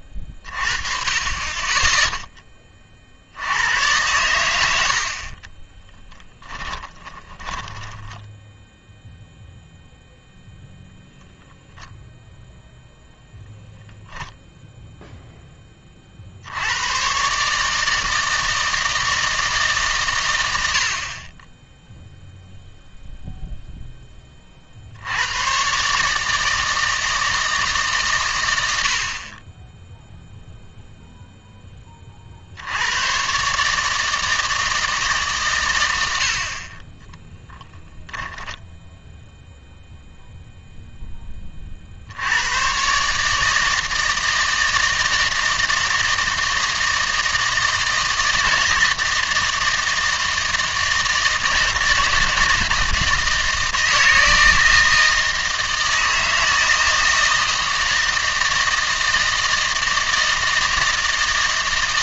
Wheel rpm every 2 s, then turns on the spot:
30, 30, 90, 20, 0, 0, 0, 0, 90, 160, 80, 0, 50, 160, 80, 0, 80, 160, 40, 10, 0, 120, 160, 160, 160, 160, 160, 160, 160, 160, 160.
6-8